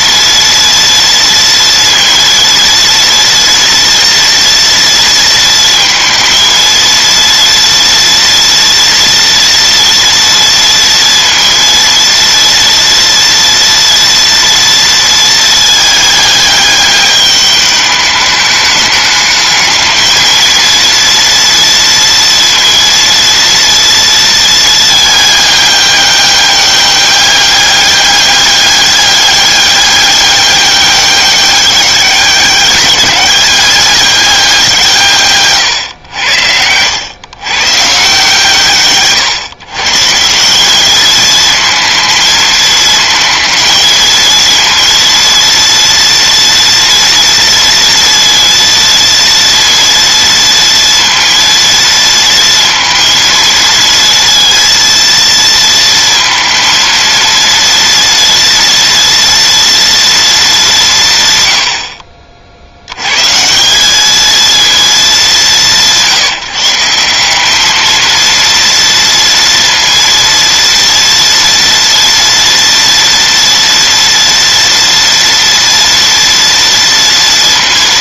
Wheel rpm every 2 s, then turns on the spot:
230, 230, 240, 230, 230, 230, 230, 230, 210, 210, 230, 230, 220, 200, 200, 200, 200, 170, 90, 150, 190, 220, 230, 240, 230, 230, 230, 230, 230, 230, 190, 70, 220, 170, 230, 230, 230, 230, 230.
none